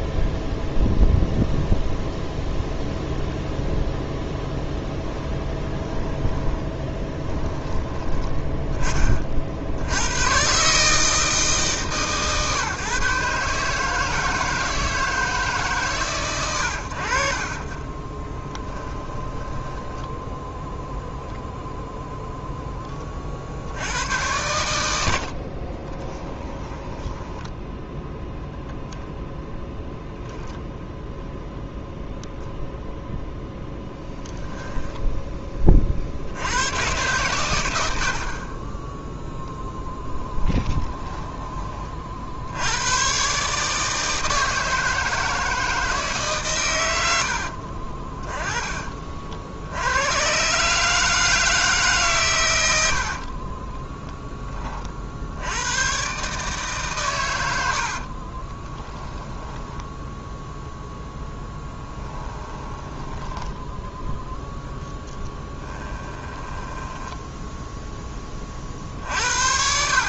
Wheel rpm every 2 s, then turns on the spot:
0, 0, 0, 10, 20, 120, 130, 160, 70, 10, 0, 10, 100, 10, 0, 0, 0, 0, 90, 20, 30, 70, 160, 120, 30, 140, 110, 20, 150, 20, 0, 10, 10, 20, 20.
6-8 18-20 26-28 40-42 58-60 62-64 66-68